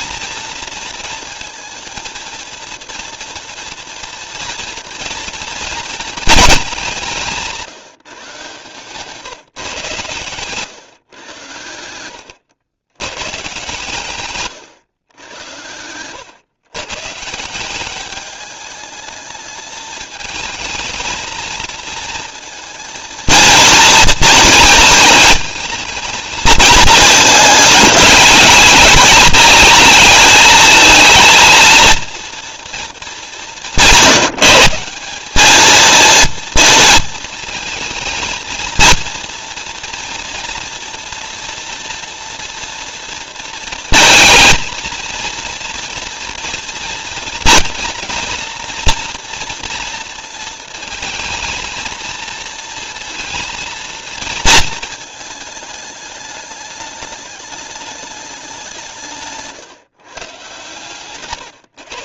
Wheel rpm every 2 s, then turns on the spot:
230, 230, 230, 210, 150, 130, 110, 130, 130, 210, 220, 230, 230, 230, 230, 230, 230, 170, 230, 230, 230, 230, 230, 230, 230, 220, 230, 230, 210, 180, 140.
60-62